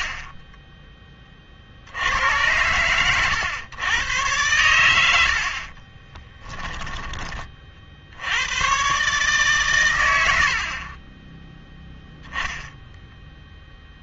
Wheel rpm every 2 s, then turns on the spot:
30, 100, 100, 10, 110, 50, 10.
0-2 6-8 10-14